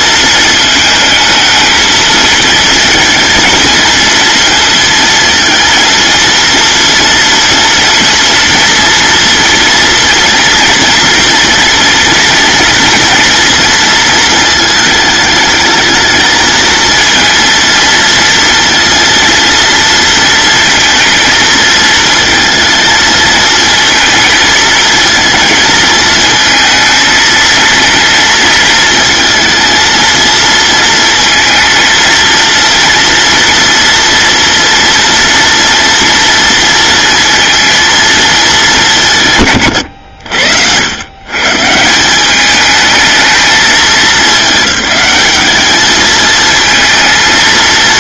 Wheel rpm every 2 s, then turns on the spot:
220, 230, 230, 230, 240, 240, 230, 210, 230, 230, 230, 220, 220, 220, 220, 230, 230, 230, 230, 180, 100, 210, 210, 220.
none